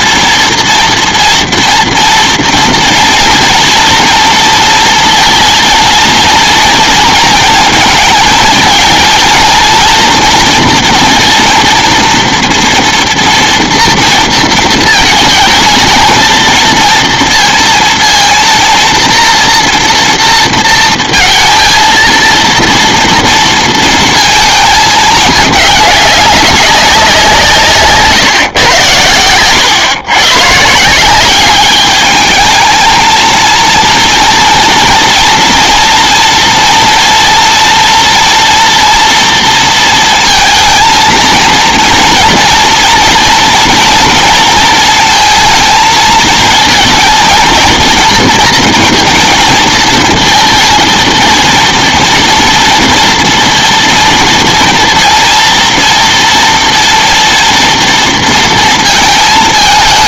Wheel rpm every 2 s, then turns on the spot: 230, 230, 230, 230, 230, 240, 230, 220, 230, 230, 230, 230, 220, 190, 110, 160, 220, 230, 230, 240, 230, 230, 230, 230, 220, 230, 230, 230, 230, 230.
none